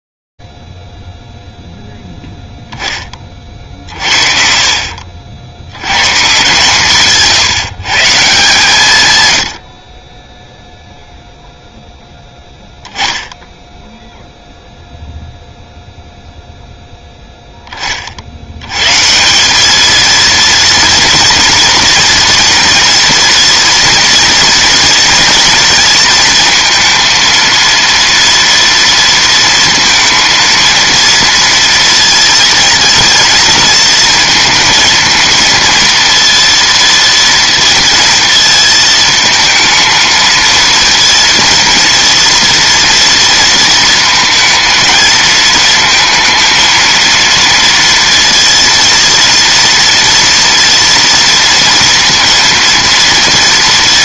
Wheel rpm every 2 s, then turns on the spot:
40, 10, 50, 140, 140, 0, 20, 0, 0, 150, 230, 240, 230, 230, 230, 230, 230, 230, 230, 220, 230, 230, 220, 230, 230, 230, 230.
none